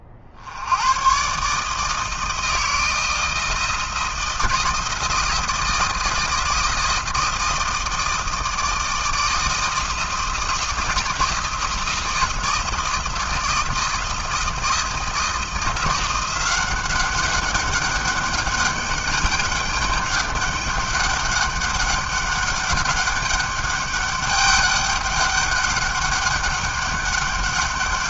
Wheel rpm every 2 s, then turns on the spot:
90, 160, 170, 170, 160, 160, 170, 160, 190, 200, 200, 200, 200, 200.
none